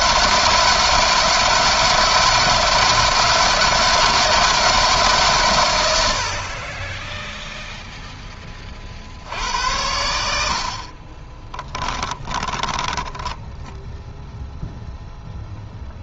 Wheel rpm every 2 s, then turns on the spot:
160, 160, 160, 30, 30, 60, 20, 10.
10-14